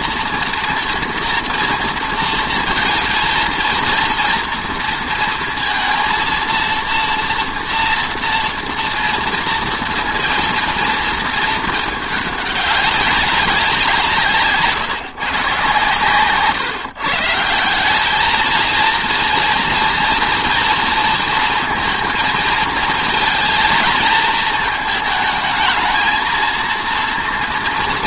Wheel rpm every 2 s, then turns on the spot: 230, 220, 230, 230, 230, 230, 200, 150, 130, 220, 230, 220, 220, 230.
none